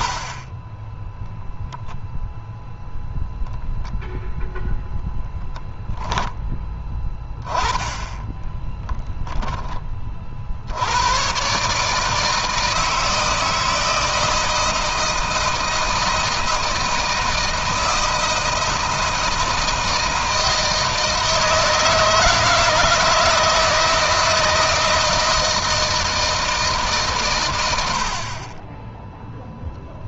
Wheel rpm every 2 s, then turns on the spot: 10, 0, 0, 10, 10, 90, 160, 160, 160, 160, 160, 160, 160, 140, 10.
none